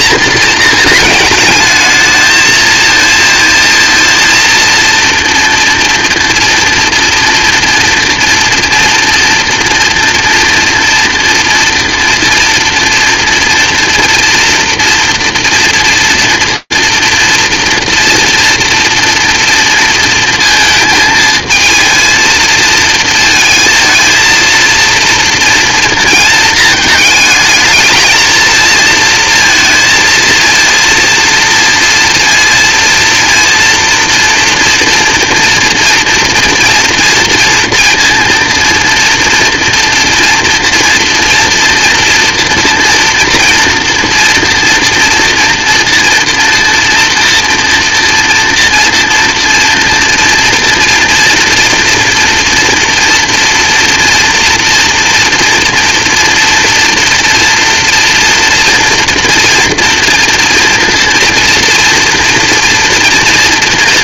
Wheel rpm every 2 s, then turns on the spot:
220, 220, 230, 230, 230, 240, 230, 230, 230, 230, 220, 230, 230, 220, 230, 230, 230, 230, 240, 230, 230, 230, 230, 240, 230, 230, 230, 230, 240, 230, 230, 240.
none